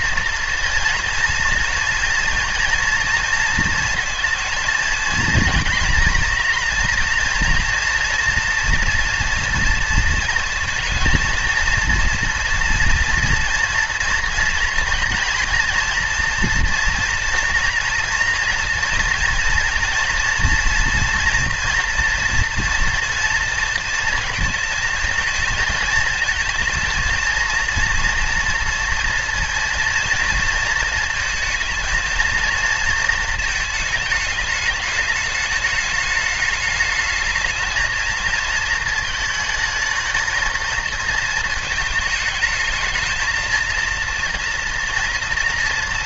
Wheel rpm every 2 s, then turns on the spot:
230, 230, 230, 240, 230, 230, 240, 230, 240, 230, 230, 230, 220, 230, 230, 230, 230, 210, 210, 230, 230, 220, 230.
none